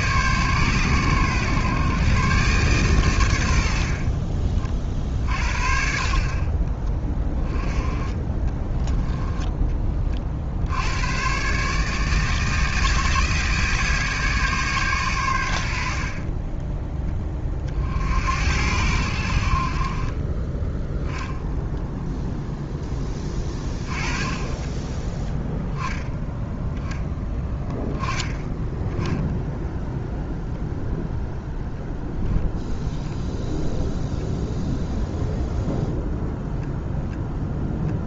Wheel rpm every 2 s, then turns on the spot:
130, 130, 50, 30, 20, 80, 160, 130, 10, 80, 10, 10, 10, 10, 10, 0, 10, 0, 0.
6-10 32-34